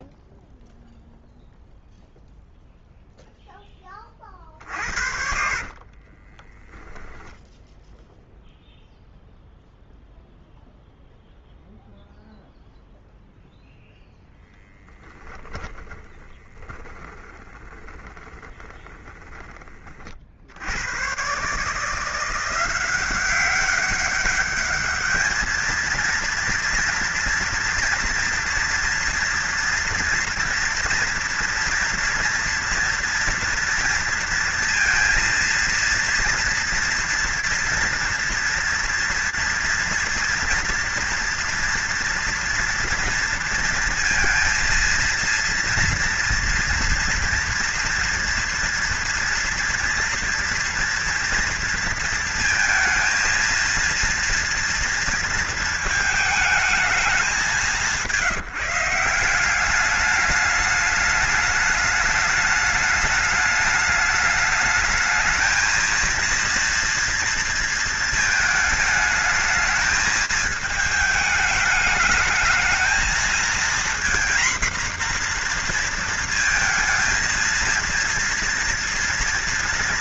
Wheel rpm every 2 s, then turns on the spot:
0, 0, 40, 20, 0, 0, 0, 20, 20, 20, 60, 180, 200, 230, 230, 240, 230, 230, 230, 230, 230, 230, 230, 230, 230, 230, 220, 230, 220, 170, 210, 210, 210, 240, 220, 220, 210, 240, 230, 230.
4-8 14-20